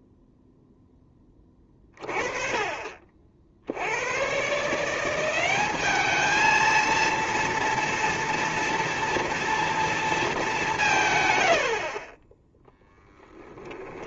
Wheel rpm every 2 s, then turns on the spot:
0, 30, 140, 220, 230, 200, 10.
none